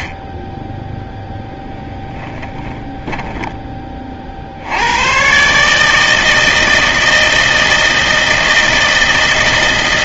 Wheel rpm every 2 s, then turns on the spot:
10, 10, 70, 160, 160.
2-4